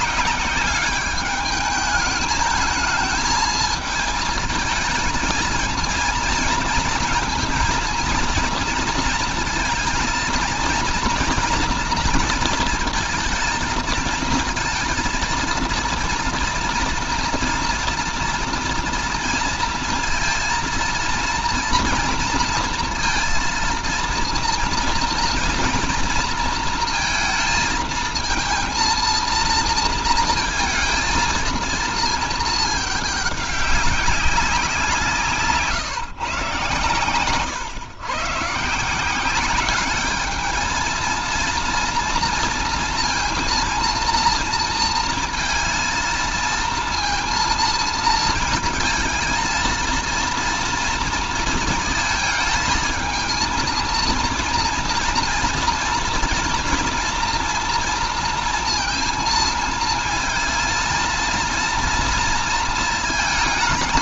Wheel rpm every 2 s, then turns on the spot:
200, 220, 230, 230, 230, 230, 230, 230, 230, 230, 230, 230, 230, 230, 230, 230, 220, 180, 140, 150, 220, 230, 230, 230, 220, 230, 220, 230, 240, 230, 230, 230.
none